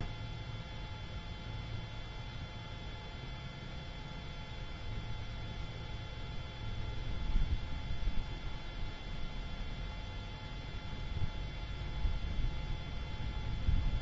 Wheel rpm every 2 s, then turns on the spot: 0, 0, 0, 0, 0, 0, 0.
none